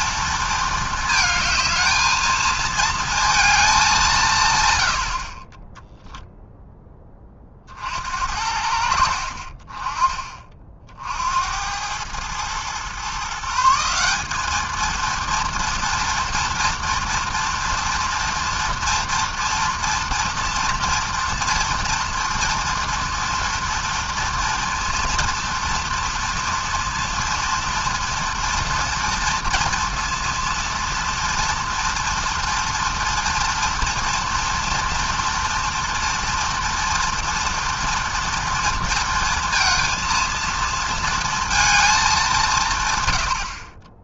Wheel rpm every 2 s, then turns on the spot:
220, 220, 130, 10, 60, 40, 120, 220, 230, 230, 230, 230, 230, 230, 240, 230, 230, 230, 230, 230, 230, 160.
none